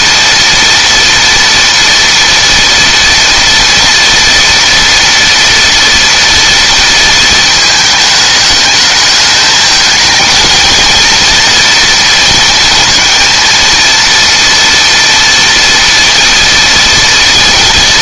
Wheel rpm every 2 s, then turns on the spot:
230, 230, 230, 230, 210, 230, 220, 230, 230.
none